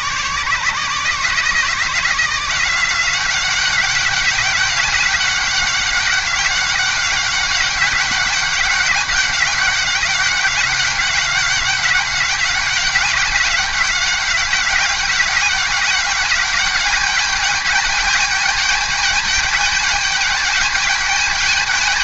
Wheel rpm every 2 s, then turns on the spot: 150, 170, 200, 200, 200, 200, 190, 190, 200, 210, 210.
none